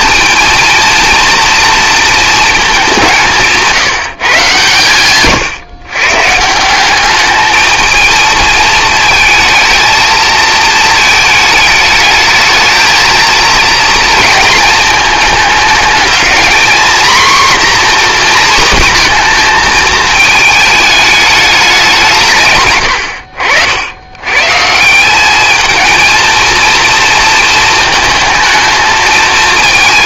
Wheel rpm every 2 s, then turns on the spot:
230, 210, 140, 170, 220, 220, 220, 230, 230, 240, 210, 120, 140, 230, 220.
none